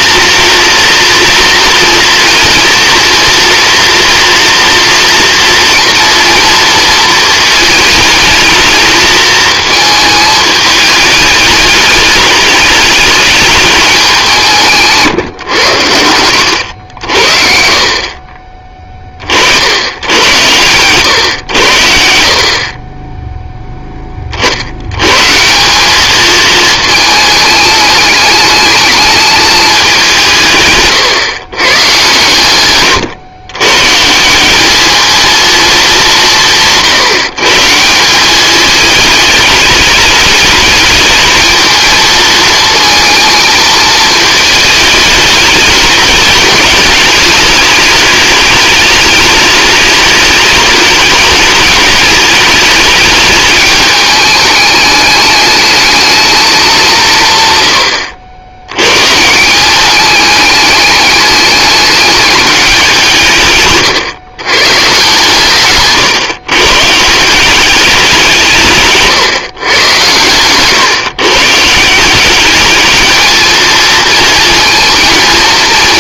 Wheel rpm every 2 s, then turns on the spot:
230, 230, 230, 230, 220, 210, 210, 160, 80, 20, 120, 30, 110, 220, 210, 120, 120, 220, 150, 210, 220, 230, 210, 210, 210, 210, 210, 210, 180, 120, 210, 190, 130, 140, 150, 140, 220, 230.
30-32